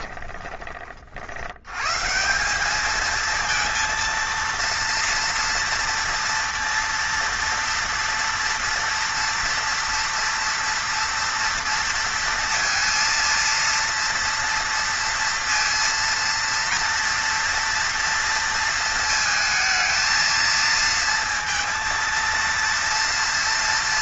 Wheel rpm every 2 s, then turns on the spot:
30, 180, 230, 230, 240, 230, 230, 230, 230, 230, 220, 230.
none